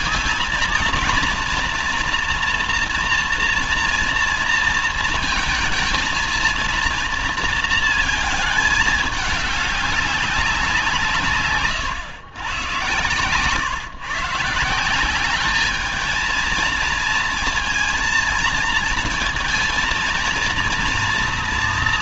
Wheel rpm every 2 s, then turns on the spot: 230, 240, 230, 230, 220, 190, 120, 160, 220, 230, 230.
none